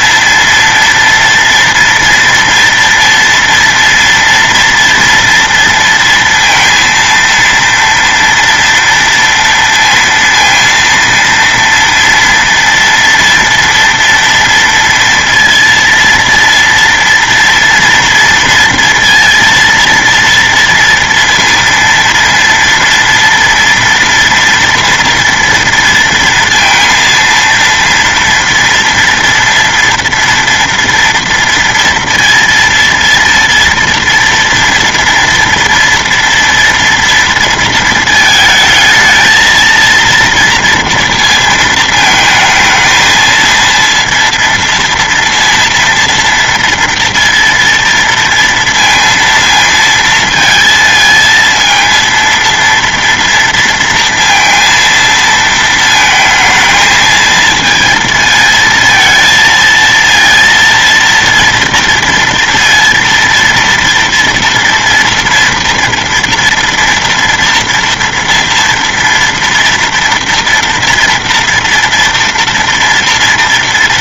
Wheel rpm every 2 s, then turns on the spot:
230, 230, 240, 230, 240, 230, 230, 230, 230, 230, 230, 230, 230, 230, 230, 230, 230, 230, 230, 220, 230, 220, 230, 230, 230, 230, 230, 230, 220, 230, 230, 230, 230, 230, 230, 230, 230.
none